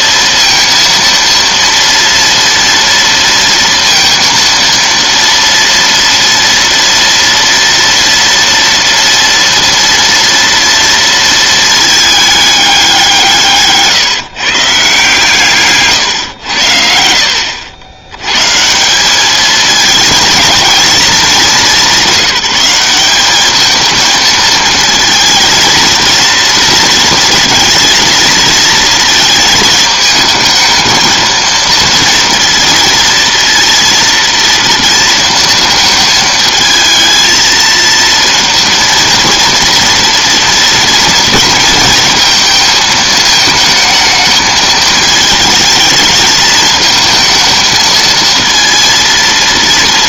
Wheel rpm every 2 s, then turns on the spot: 230, 230, 230, 230, 230, 230, 200, 150, 90, 160, 230, 190, 230, 230, 230, 220, 230, 230, 220, 230, 230, 220, 220, 220, 230.
none